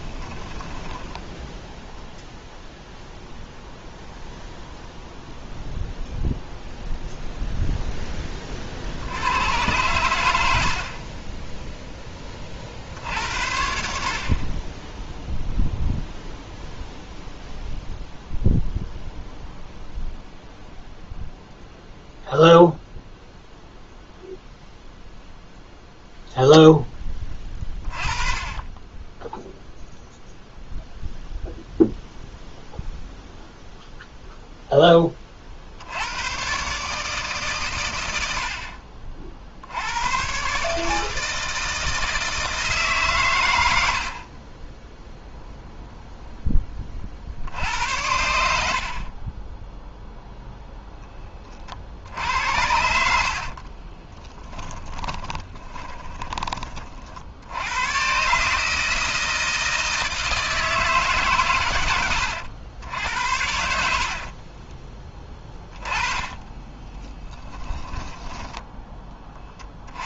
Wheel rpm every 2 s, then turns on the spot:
10, 0, 0, 0, 30, 90, 30, 30, 0, 0, 0, 0, 0, 0, 20, 0, 0, 0, 110, 80, 120, 160, 40, 10, 70, 0, 70, 20, 20, 140, 160, 90, 40, 20, 10.
0-2 10-12 54-56 64-68